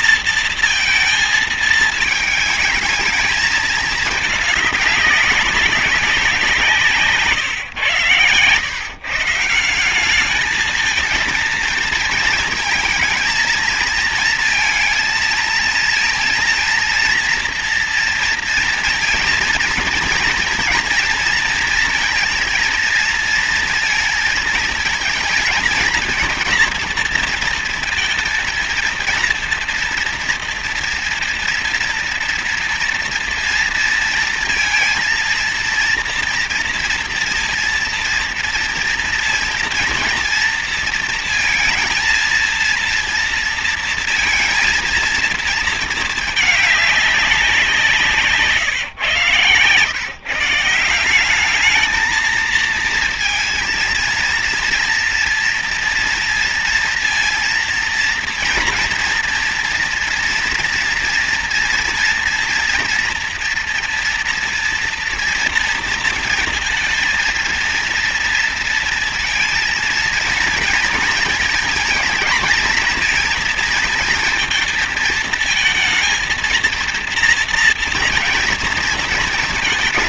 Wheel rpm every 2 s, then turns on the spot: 230, 220, 210, 180, 120, 210, 220, 230, 230, 230, 230, 230, 230, 230, 230, 230, 230, 230, 230, 230, 230, 230, 230, 220, 150, 160, 220, 230, 230, 240, 240, 230, 230, 230, 230, 230, 220, 230, 230, 240.
none